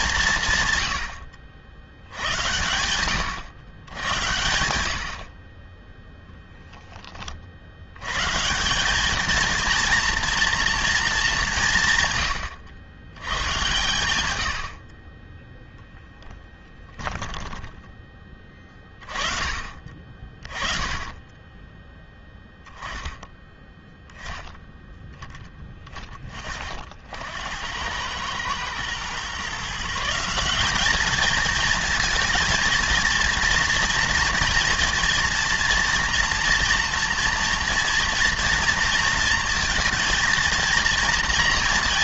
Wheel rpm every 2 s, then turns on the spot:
110, 110, 80, 10, 190, 230, 110, 60, 10, 30, 20, 10, 10, 60, 110, 210, 230, 230, 230, 230, 230.
16-18